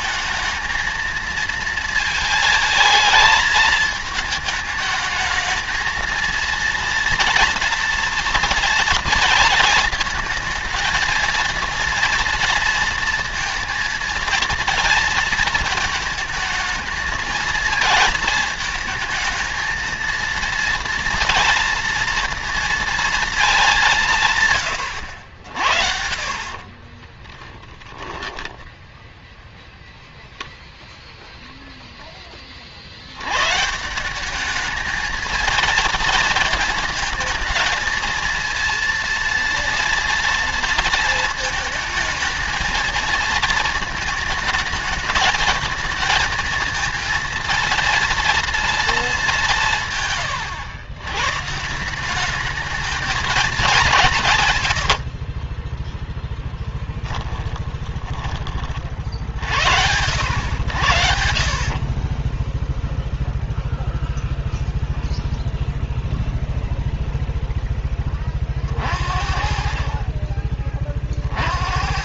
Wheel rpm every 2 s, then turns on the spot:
220, 220, 220, 230, 230, 230, 230, 230, 220, 220, 230, 230, 100, 30, 0, 0, 70, 220, 220, 230, 230, 230, 220, 230, 220, 120, 220, 70, 10, 40, 90, 0, 0, 0, 50, 30.
26-28 54-58